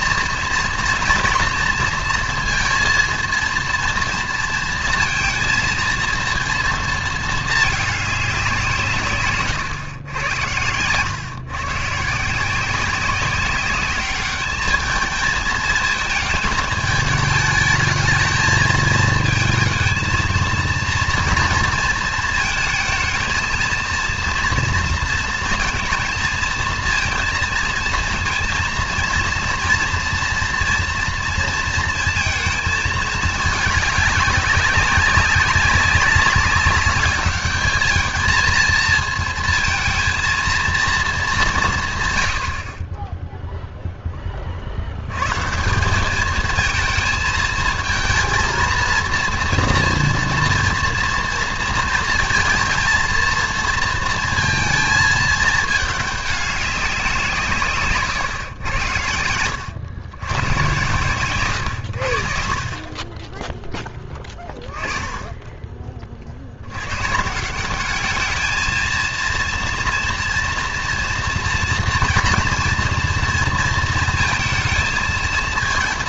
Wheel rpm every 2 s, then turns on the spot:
230, 230, 230, 230, 160, 110, 180, 210, 220, 220, 230, 220, 230, 220, 230, 230, 220, 190, 200, 230, 230, 60, 60, 220, 230, 230, 230, 220, 200, 110, 120, 40, 20, 90, 220, 240, 230, 230.
10-12